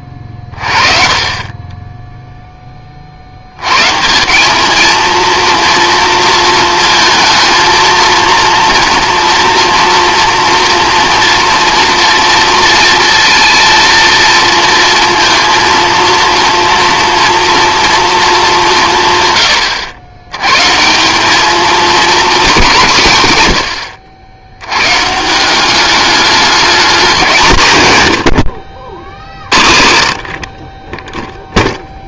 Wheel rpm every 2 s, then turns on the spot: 30, 20, 210, 230, 230, 240, 230, 230, 230, 180, 140, 190, 100, 210, 60, 30.
none